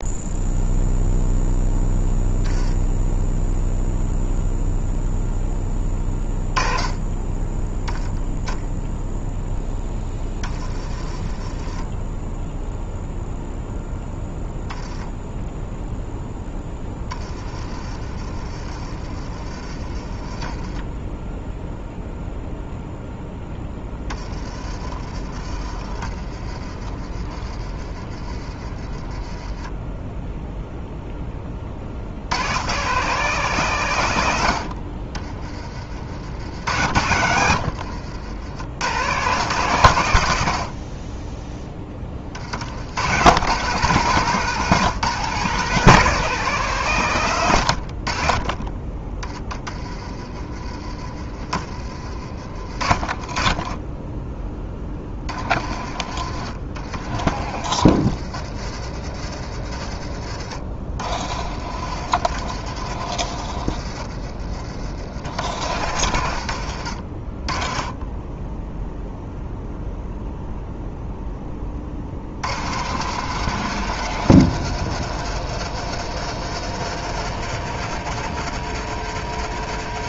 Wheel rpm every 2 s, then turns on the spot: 0, 10, 0, 10, 0, 30, 0, 10, 10, 40, 20, 0, 30, 40, 30, 0, 130, 70, 90, 110, 40, 80, 160, 160, 30, 30, 40, 20, 50, 50, 40, 60, 50, 60, 10, 0, 80, 110, 110, 100.
10-12 18-20 24-28 36-38 48-50 52-54